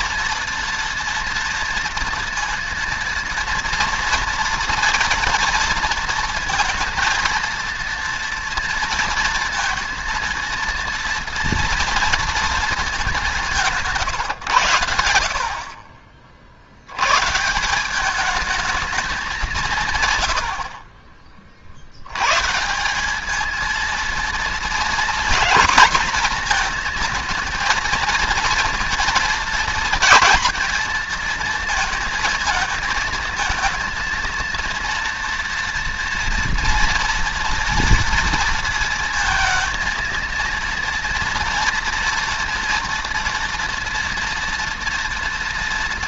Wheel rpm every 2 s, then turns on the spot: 230, 230, 230, 230, 230, 230, 230, 120, 70, 210, 90, 140, 230, 240, 230, 230, 230, 230, 240, 230, 230, 230, 230.
none